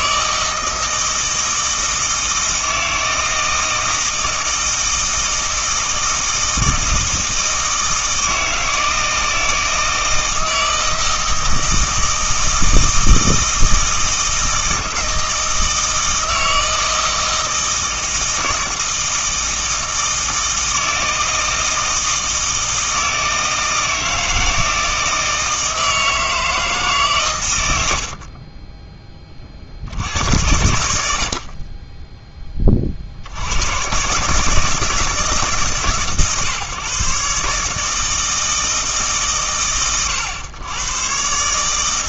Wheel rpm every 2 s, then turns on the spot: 160, 160, 160, 160, 160, 160, 160, 160, 160, 160, 160, 160, 160, 150, 20, 80, 30, 150, 140, 160, 110.
none